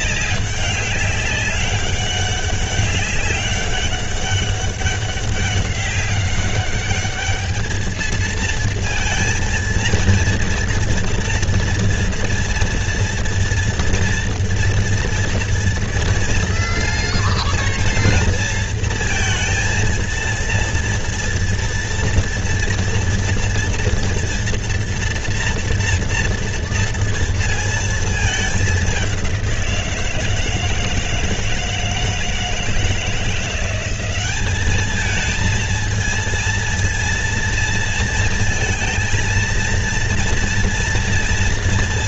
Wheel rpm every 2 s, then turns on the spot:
200, 200, 200, 200, 230, 230, 230, 230, 230, 230, 230, 230, 230, 230, 210, 160, 160, 200, 230, 230, 230.
none